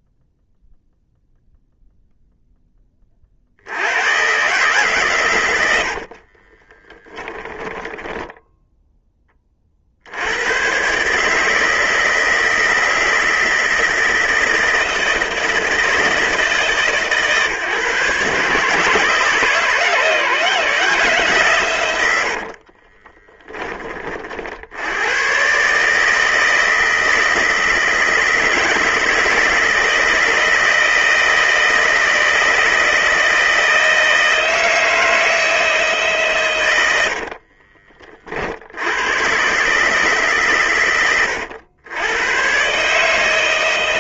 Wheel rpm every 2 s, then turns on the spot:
0, 10, 120, 30, 0, 100, 160, 160, 150, 140, 140, 60, 60, 160, 160, 160, 160, 160, 120, 60, 130, 130.
6-8 22-24